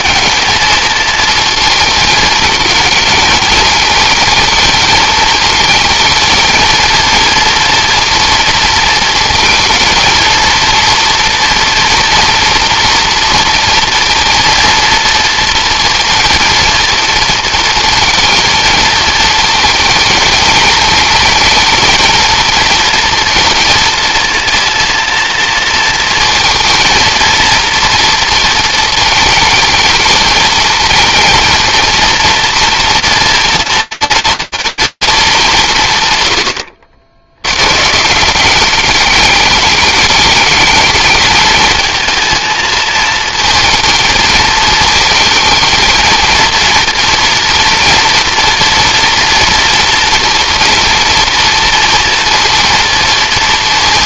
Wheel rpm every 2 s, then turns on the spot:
220, 220, 220, 220, 220, 230, 230, 230, 230, 220, 220, 230, 230, 230, 230, 220, 230, 240, 80, 200, 220, 220, 220, 230, 240, 240, 230.
none